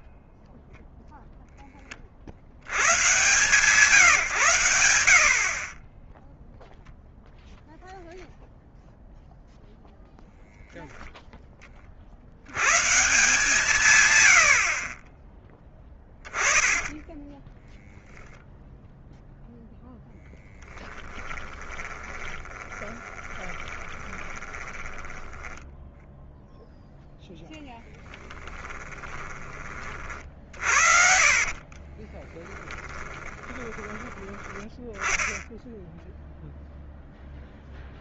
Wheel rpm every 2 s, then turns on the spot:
10, 90, 100, 0, 0, 0, 120, 60, 20, 0, 10, 30, 10, 0, 20, 60, 20, 10, 10.
16-18 22-26 28-34